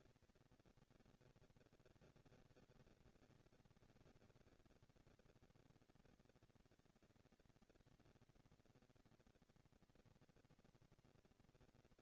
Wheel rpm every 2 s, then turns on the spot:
220, 200, 200, 220, 240, 230.
none